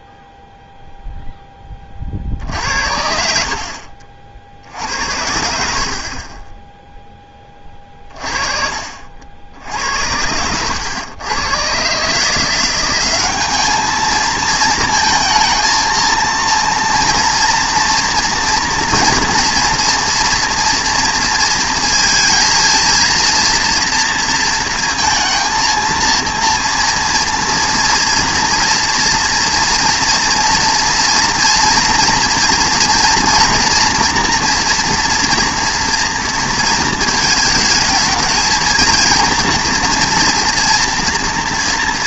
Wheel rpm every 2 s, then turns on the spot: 0, 50, 110, 10, 50, 100, 180, 220, 230, 230, 230, 230, 230, 230, 230, 230, 230, 230, 230, 230, 230.
none